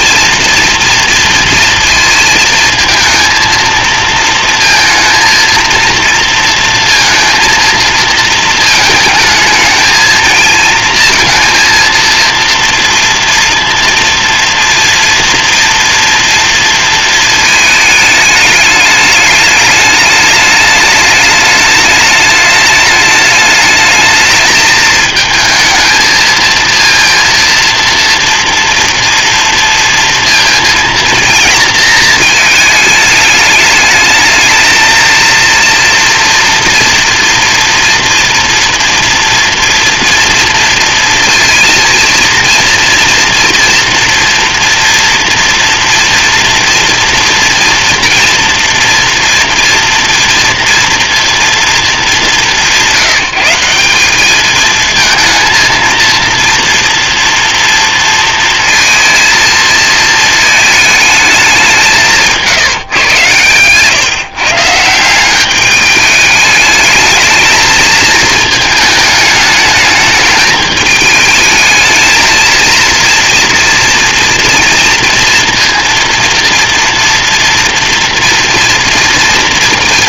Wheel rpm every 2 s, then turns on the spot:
230, 230, 230, 230, 220, 230, 230, 230, 220, 210, 210, 210, 220, 230, 230, 230, 210, 230, 230, 240, 230, 230, 230, 230, 230, 230, 180, 220, 230, 230, 190, 120, 200, 220, 210, 220, 230, 230, 230, 200.
none